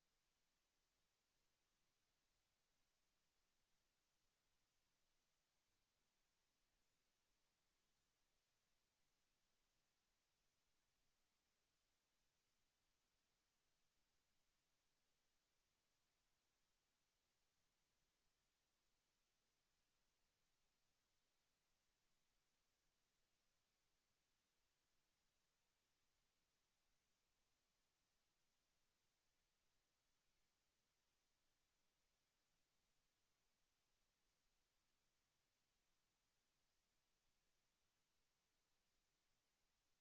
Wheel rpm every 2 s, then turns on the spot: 0, 0, 0, 0, 0, 0, 0, 0, 0, 0, 0, 0, 0, 0, 0, 0, 0, 0, 0, 0.
none